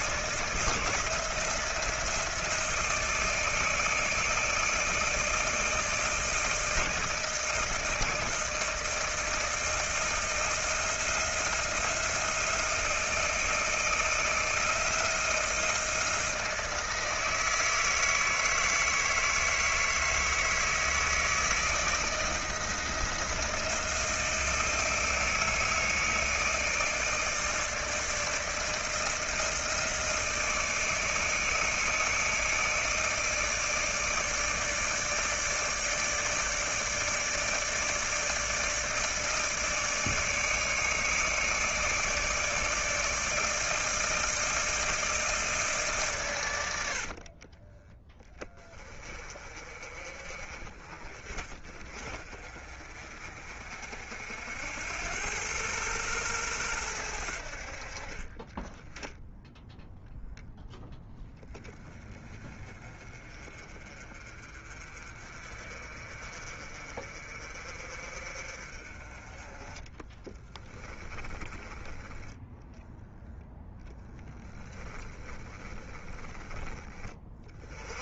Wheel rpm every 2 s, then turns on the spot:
160, 160, 160, 160, 160, 160, 160, 160, 160, 160, 160, 160, 160, 160, 160, 160, 160, 160, 150, 160, 150, 160, 160, 70, 20, 40, 40, 90, 90, 10, 0, 30, 40, 40, 30, 20, 10, 10, 30.
46-48 70-72 74-76